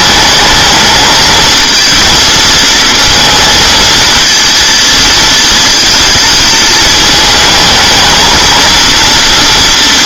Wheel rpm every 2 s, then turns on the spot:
220, 230, 230, 220, 230.
none